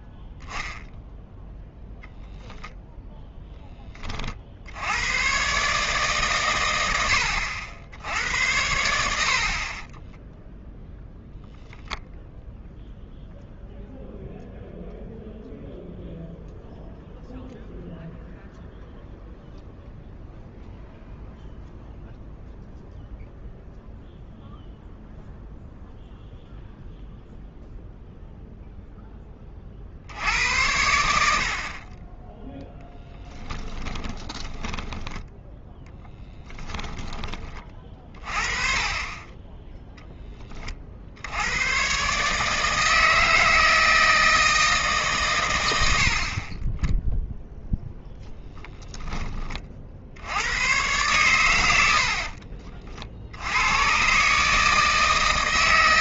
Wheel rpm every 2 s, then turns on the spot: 0, 0, 50, 120, 90, 0, 0, 0, 0, 0, 0, 0, 0, 0, 0, 80, 10, 10, 10, 40, 30, 150, 160, 40, 10, 90, 40, 150.
34-36 52-54